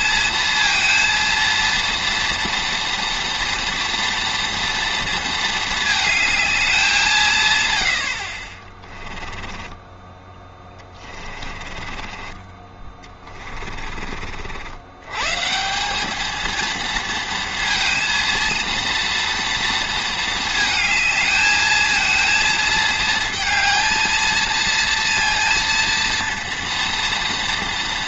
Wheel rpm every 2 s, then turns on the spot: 230, 230, 230, 180, 30, 20, 20, 100, 220, 230, 220, 230, 230, 230.
8-14